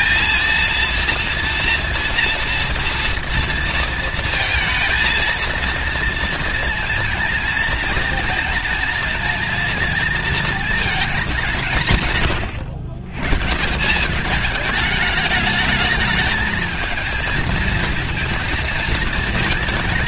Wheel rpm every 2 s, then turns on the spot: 230, 230, 220, 230, 230, 220, 120, 210, 220, 230.
none